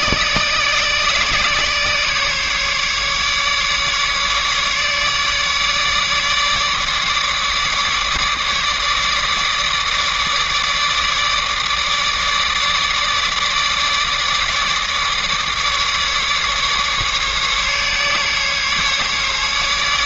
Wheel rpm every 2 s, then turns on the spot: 140, 140, 150, 150, 150, 150, 150, 150, 150, 140.
none